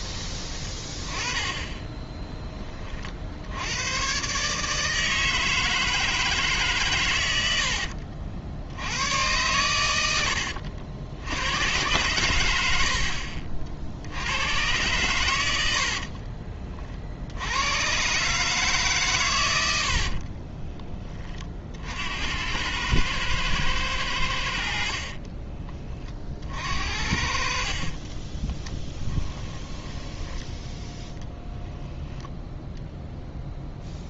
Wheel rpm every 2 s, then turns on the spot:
20, 30, 150, 120, 90, 80, 60, 120, 50, 140, 20, 100, 50, 60, 20, 10, 0.
28-30